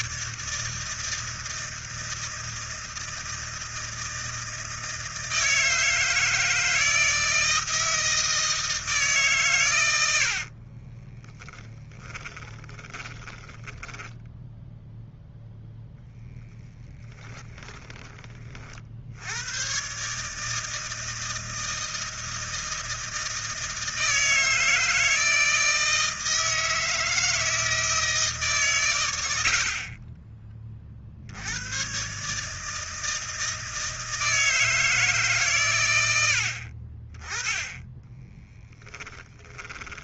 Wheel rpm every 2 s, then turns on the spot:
160, 160, 160, 160, 160, 40, 20, 0, 10, 50, 160, 160, 160, 160, 120, 40, 160, 160, 60, 10.
10-14 16-18 38-40